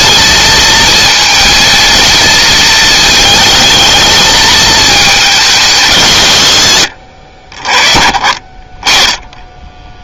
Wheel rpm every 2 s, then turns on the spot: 220, 220, 220, 100, 30.
8-10